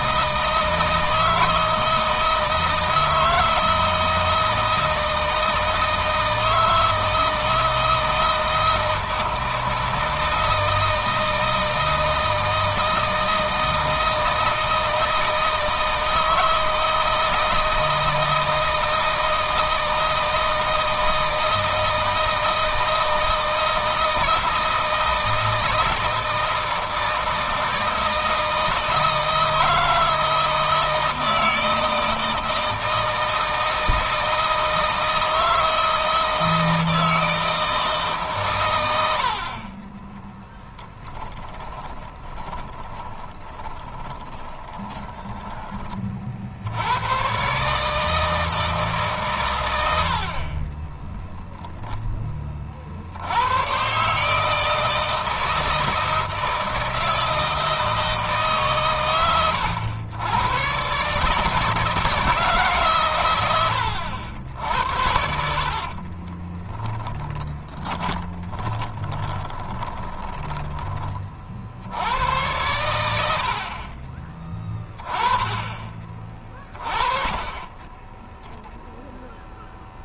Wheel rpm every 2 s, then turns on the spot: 160, 160, 160, 160, 160, 160, 160, 160, 160, 160, 160, 160, 160, 160, 160, 160, 160, 160, 160, 110, 10, 20, 10, 70, 160, 30, 50, 160, 160, 140, 110, 150, 80, 10, 20, 20, 100, 20, 30, 0.
40-46 66-70